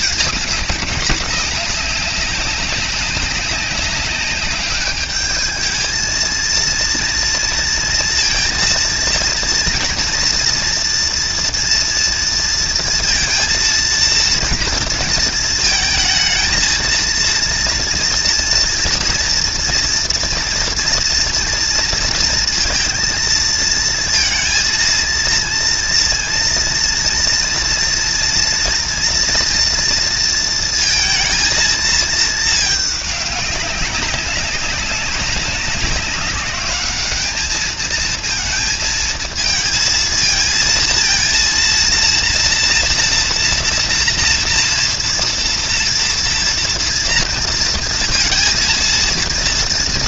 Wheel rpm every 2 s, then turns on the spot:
210, 200, 200, 230, 230, 230, 230, 230, 220, 230, 230, 230, 230, 230, 230, 230, 220, 200, 200, 230, 230, 230, 230, 230, 230.
none